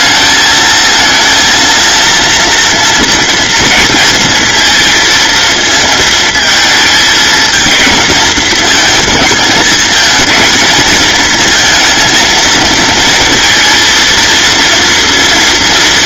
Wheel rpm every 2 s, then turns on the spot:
220, 230, 230, 220, 220, 220, 230, 240.
none